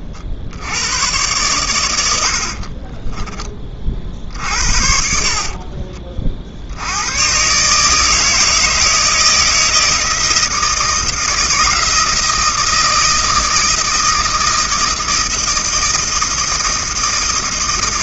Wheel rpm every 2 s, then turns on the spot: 100, 20, 50, 110, 160, 160, 160, 160, 160.
2-6